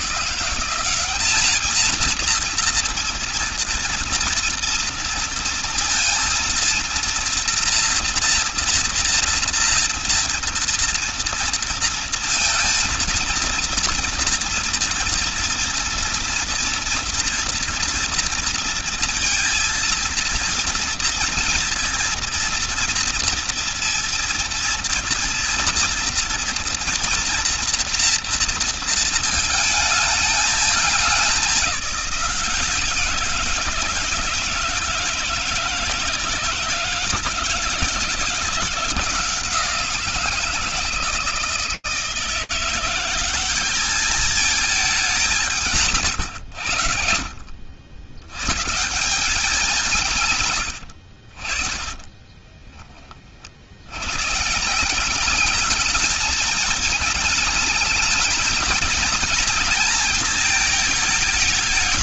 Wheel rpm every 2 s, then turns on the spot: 190, 230, 230, 230, 230, 230, 230, 230, 230, 230, 230, 230, 230, 230, 220, 210, 170, 170, 160, 170, 160, 180, 210, 100, 150, 90, 40, 190, 220, 220, 210.
50-52